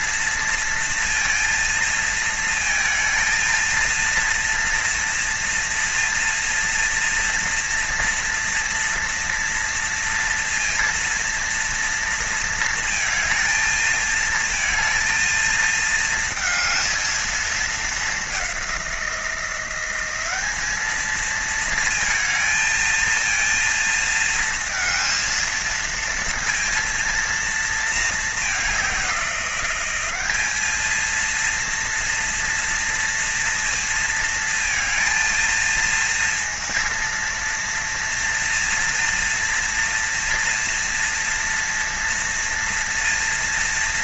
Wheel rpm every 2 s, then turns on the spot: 230, 230, 230, 230, 230, 230, 230, 230, 230, 190, 210, 230, 220, 230, 200, 210, 230, 230, 230, 230, 230, 230.
none